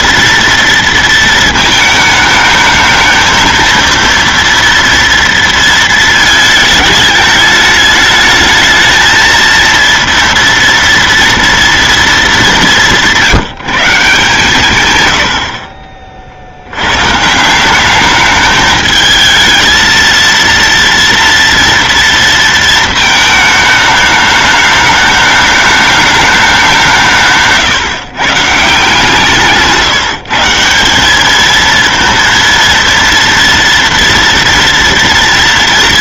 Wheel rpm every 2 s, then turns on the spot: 230, 220, 230, 220, 210, 230, 220, 150, 40, 210, 230, 230, 210, 210, 140, 160, 230, 230.
none